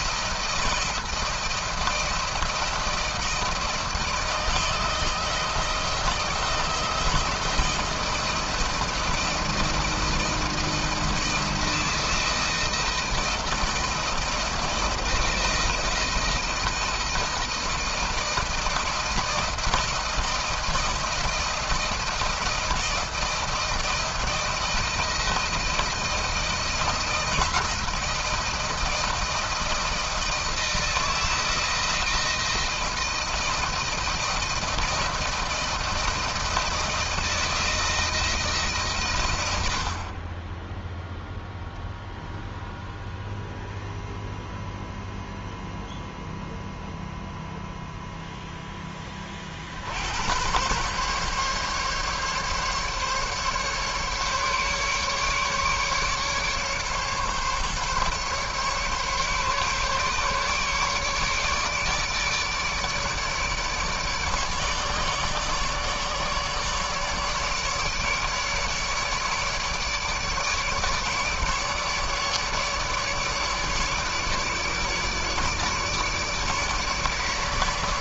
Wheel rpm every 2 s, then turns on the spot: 170, 160, 160, 170, 170, 160, 160, 160, 160, 160, 160, 160, 160, 160, 160, 160, 160, 160, 160, 140, 10, 0, 0, 0, 10, 120, 140, 140, 140, 140, 140, 150, 150, 150, 150, 150, 150, 150, 150.
none